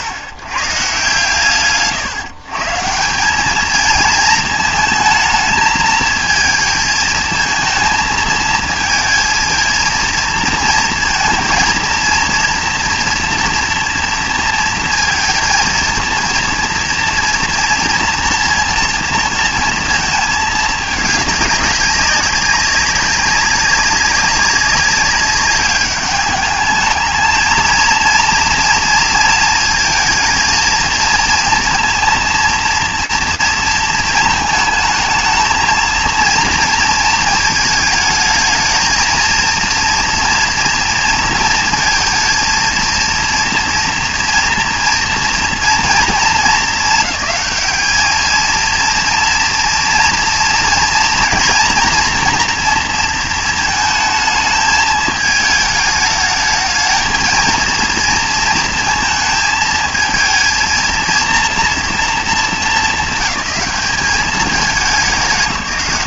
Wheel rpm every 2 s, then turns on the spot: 80, 140, 220, 220, 230, 230, 230, 230, 230, 230, 210, 200, 200, 210, 230, 220, 230, 220, 230, 220, 230, 230, 230, 220, 230, 230, 230, 220, 220, 220, 230, 210, 210.
none